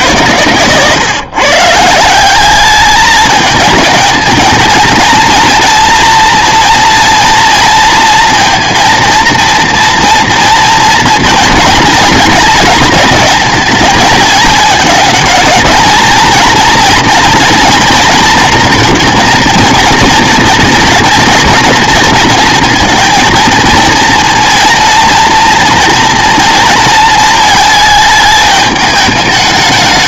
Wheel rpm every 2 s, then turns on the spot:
120, 210, 220, 230, 230, 230, 220, 210, 230, 230, 230, 230, 230, 230, 210.
0-2